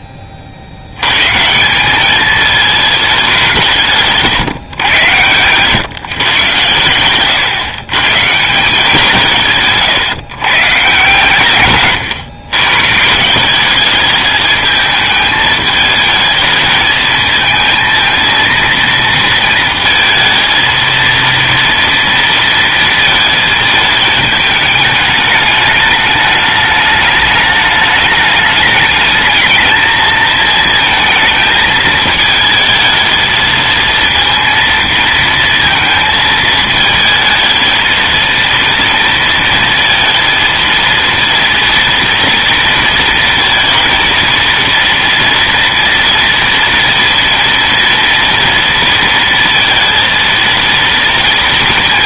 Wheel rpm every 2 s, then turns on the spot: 80, 210, 110, 120, 180, 130, 130, 220, 220, 230, 230, 230, 210, 210, 220, 220, 220, 230, 220, 230, 230, 230, 230, 230, 230, 230.
none